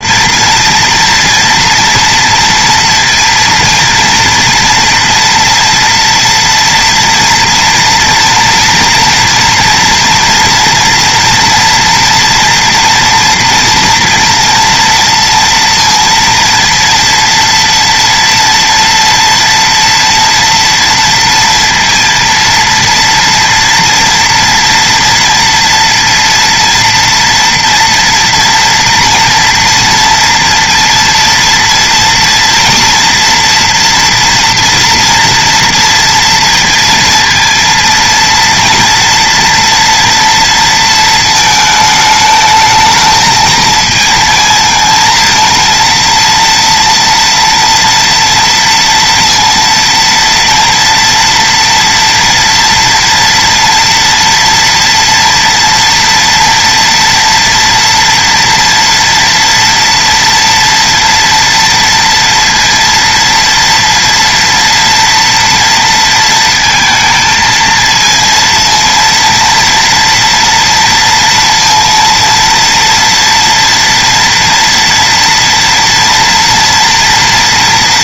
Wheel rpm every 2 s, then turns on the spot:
230, 230, 230, 240, 230, 230, 230, 230, 230, 230, 230, 230, 230, 230, 240, 230, 240, 240, 230, 230, 230, 220, 230, 230, 230, 240, 230, 230, 230, 230, 240, 230, 230, 230, 230, 230, 230, 230, 230.
none